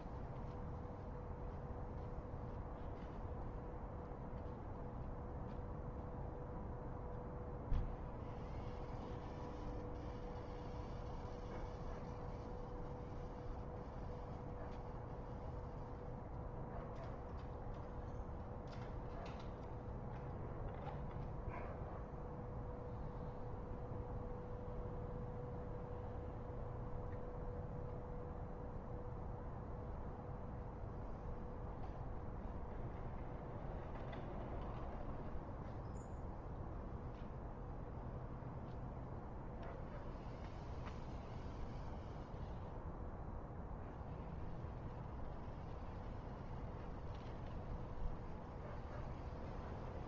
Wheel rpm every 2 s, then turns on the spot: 0, 0, 0, 0, 0, 0, 0, 0, 0, 0, 0, 0, 0, 0, 0, 0, 0, 0, 0, 0, 0, 0, 0, 0, 0.
none